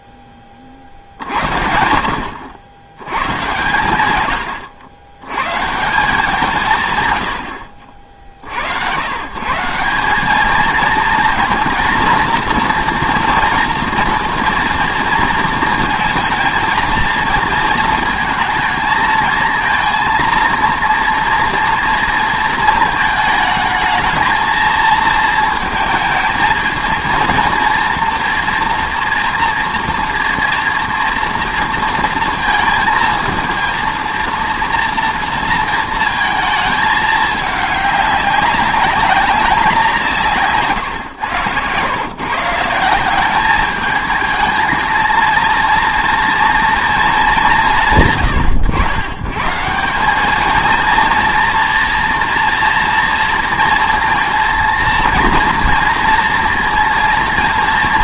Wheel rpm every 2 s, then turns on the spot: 40, 90, 90, 150, 90, 220, 230, 230, 220, 220, 230, 230, 230, 230, 240, 240, 230, 230, 220, 200, 140, 170, 220, 230, 110, 230, 230, 230, 230.
none